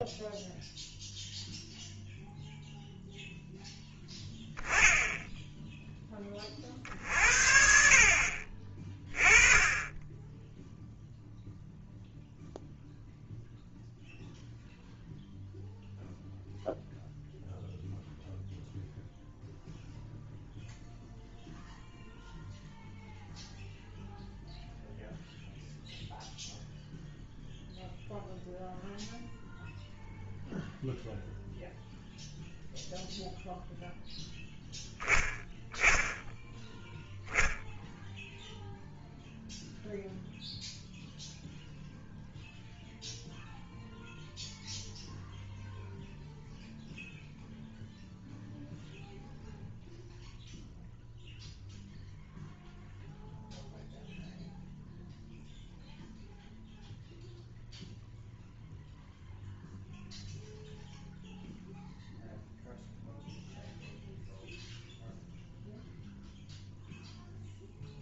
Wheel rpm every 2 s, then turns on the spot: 0, 0, 10, 50, 30, 0, 0, 0, 0, 0, 0, 0, 0, 0, 0, 0, 0, 10, 0, 0, 0, 0, 0, 0, 0, 0, 0, 0, 0, 0, 0, 0, 0, 0.
none